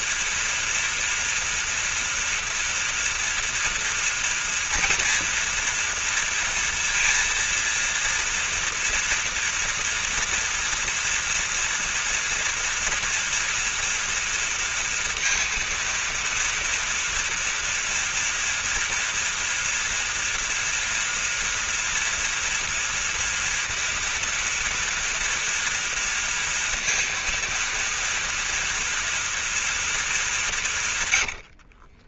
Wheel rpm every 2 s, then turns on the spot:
230, 230, 230, 230, 230, 230, 240, 230, 230, 230, 240, 240, 230, 230, 230, 160.
none